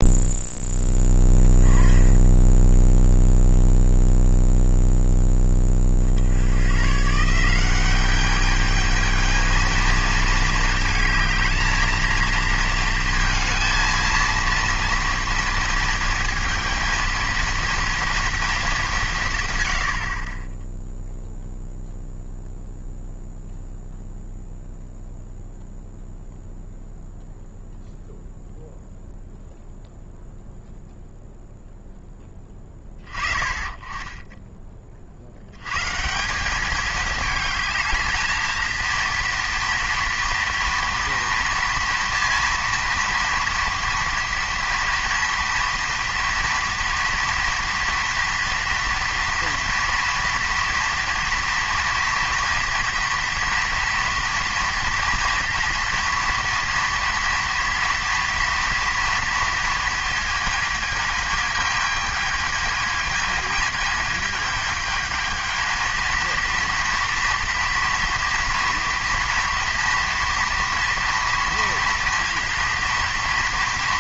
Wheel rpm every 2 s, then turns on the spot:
10, 0, 10, 160, 220, 220, 230, 230, 230, 160, 0, 0, 0, 0, 0, 0, 30, 70, 220, 230, 230, 230, 230, 230, 230, 230, 230, 230, 230, 230, 220, 220, 220, 230, 230, 230, 230.
none